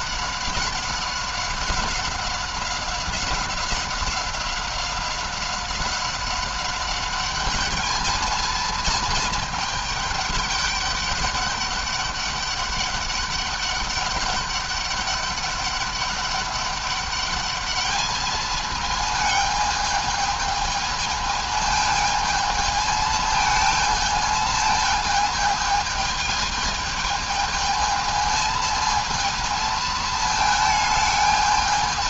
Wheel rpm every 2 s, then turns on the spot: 190, 190, 190, 190, 220, 200, 200, 200, 200, 220, 220, 220, 220, 220, 220, 220.
none